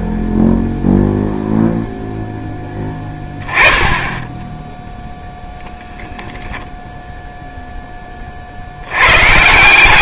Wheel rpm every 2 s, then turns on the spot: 0, 10, 0, 10, 120.
none